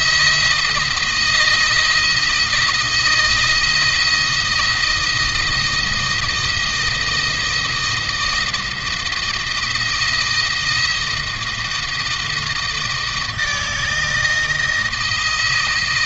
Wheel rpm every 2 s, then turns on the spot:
160, 160, 160, 170, 160, 160, 160, 160.
none